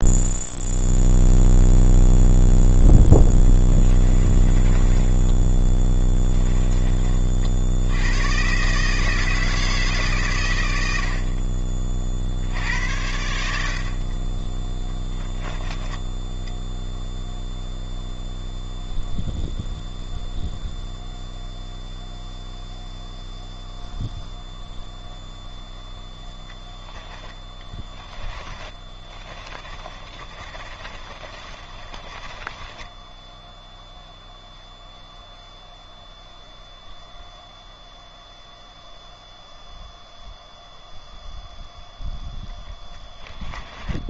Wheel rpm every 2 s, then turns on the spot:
0, 10, 20, 20, 150, 60, 80, 10, 0, 0, 0, 0, 0, 10, 20, 40, 10, 0, 0, 0, 0, 10.
4-6 28-34 42-44